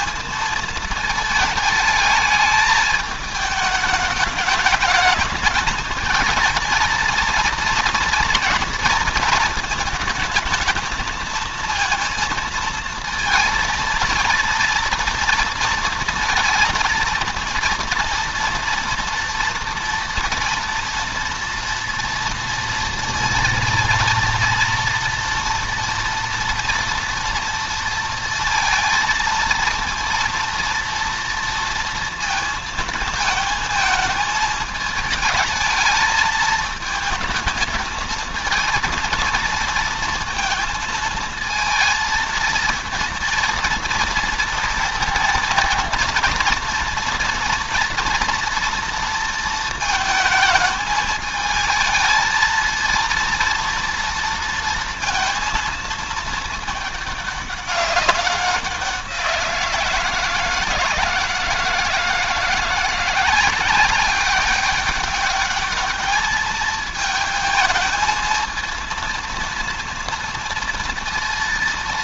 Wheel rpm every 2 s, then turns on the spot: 220, 210, 220, 230, 230, 220, 230, 230, 230, 230, 230, 230, 230, 230, 230, 230, 230, 220, 220, 230, 230, 230, 230, 230, 230, 220, 230, 230, 210, 180, 160, 180, 200, 220, 230, 230.
none